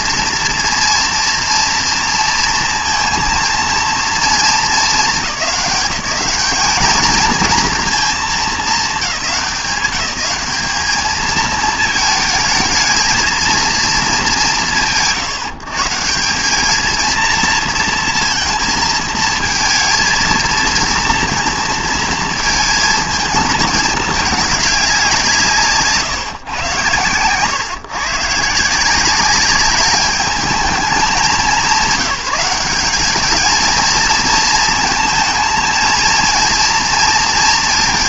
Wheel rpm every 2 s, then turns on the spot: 230, 230, 210, 210, 200, 210, 220, 150, 220, 220, 230, 220, 200, 120, 170, 200, 200, 230, 230.
none